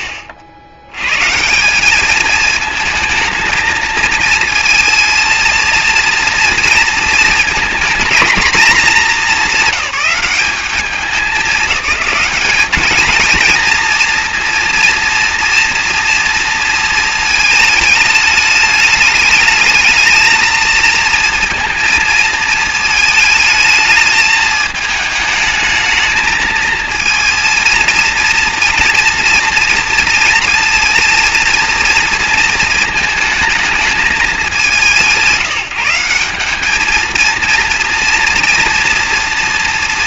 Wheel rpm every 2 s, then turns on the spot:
70, 220, 230, 230, 210, 200, 220, 230, 230, 210, 220, 220, 220, 220, 230, 230, 230, 180, 220, 220.
none